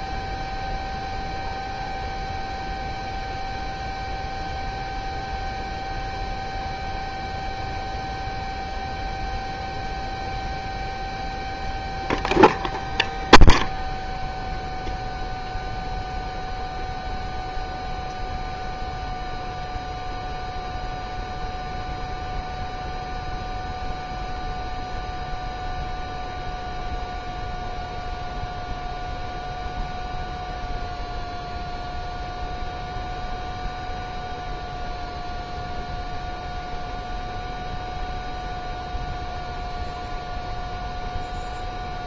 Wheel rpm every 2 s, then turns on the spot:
0, 0, 0, 0, 0, 0, 0, 0, 0, 0, 0, 0, 0, 0, 0, 0, 0, 0, 0, 0, 0.
none